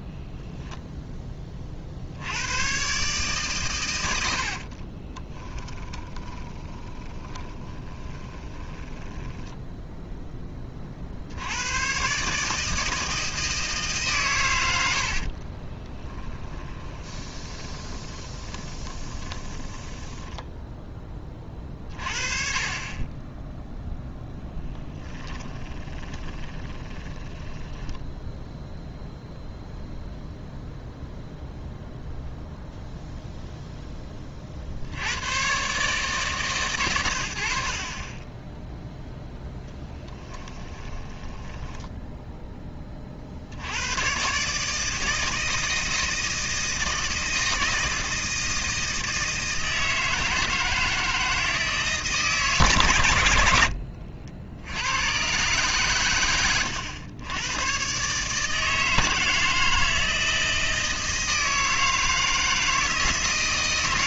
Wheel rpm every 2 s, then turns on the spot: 0, 120, 30, 20, 10, 40, 160, 80, 20, 20, 10, 30, 10, 20, 0, 0, 0, 70, 120, 0, 20, 20, 160, 160, 160, 160, 130, 100, 90, 160, 160, 160.
4-10 16-20 24-28 40-42